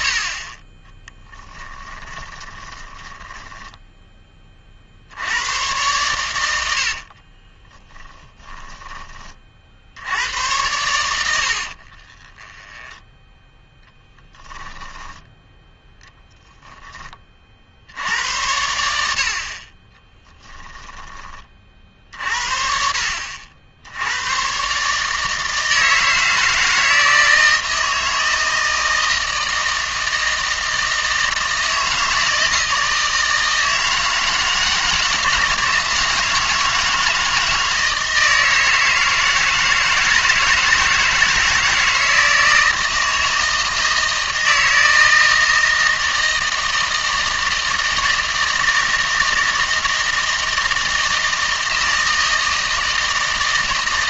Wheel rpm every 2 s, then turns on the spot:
30, 20, 40, 80, 10, 110, 10, 10, 10, 90, 10, 60, 140, 160, 160, 160, 160, 160, 160, 160, 160, 160, 160, 160, 160, 160, 160.
0-4 6-8 12-16 20-22